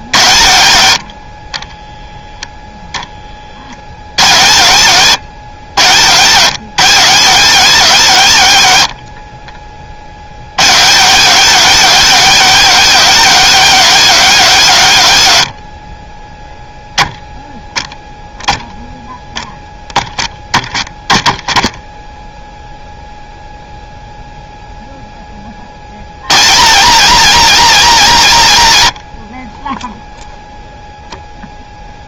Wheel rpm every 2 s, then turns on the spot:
60, 20, 140, 170, 60, 160, 210, 120, 10, 10, 10, 0, 10, 200, 90, 0.
none